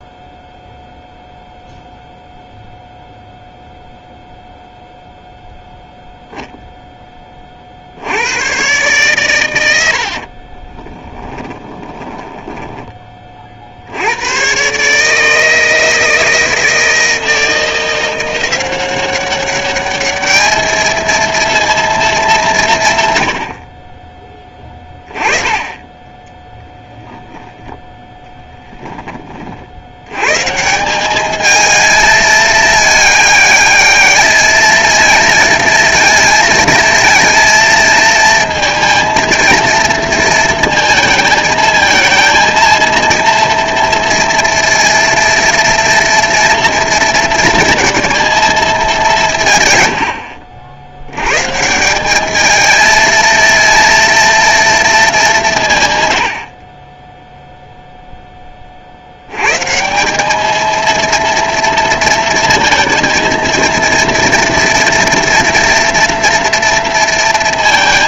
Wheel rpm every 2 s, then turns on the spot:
0, 0, 0, 0, 110, 30, 20, 140, 160, 180, 220, 150, 10, 10, 10, 170, 210, 220, 220, 230, 230, 230, 230, 230, 210, 80, 220, 230, 30, 40, 220, 230, 230, 230.
10-12 26-30